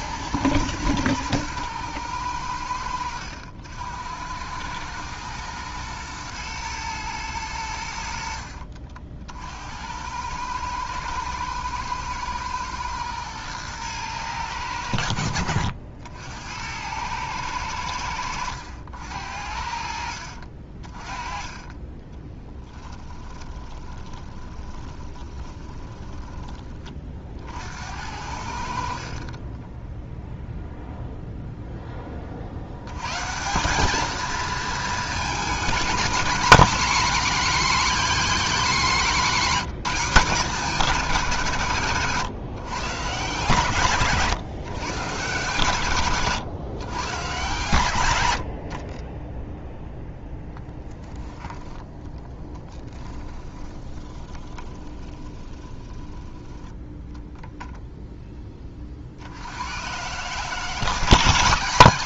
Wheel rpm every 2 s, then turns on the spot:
120, 90, 110, 120, 60, 110, 110, 90, 100, 80, 40, 10, 20, 30, 60, 0, 100, 220, 240, 220, 190, 140, 130, 120, 50, 0, 10, 20, 10, 40, 160.
2-4 22-26 28-30 52-56